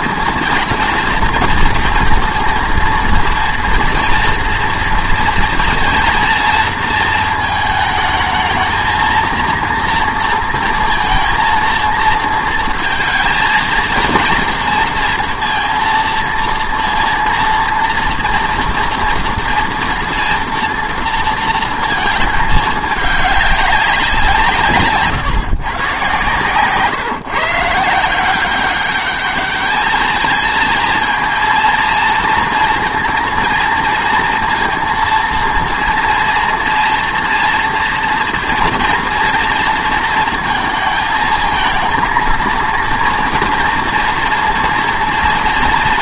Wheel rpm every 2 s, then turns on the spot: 230, 230, 230, 230, 220, 230, 230, 230, 230, 230, 240, 210, 150, 130, 190, 220, 230, 230, 230, 230, 230, 230, 230.
none